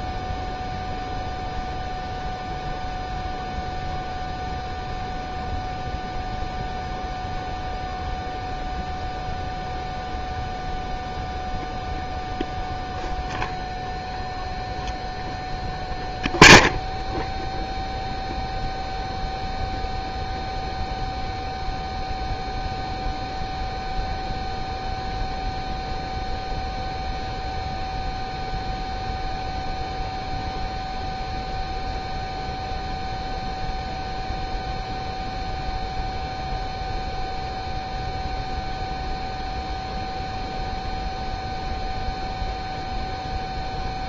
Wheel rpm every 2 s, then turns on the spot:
0, 0, 0, 0, 0, 0, 0, 0, 0, 0, 0, 0, 0, 0, 0, 0, 0, 0, 0, 0, 0, 0.
none